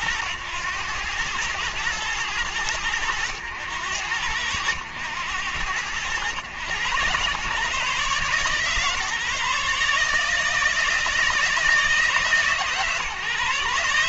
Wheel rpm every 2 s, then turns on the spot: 100, 100, 90, 110, 140, 160, 140.
none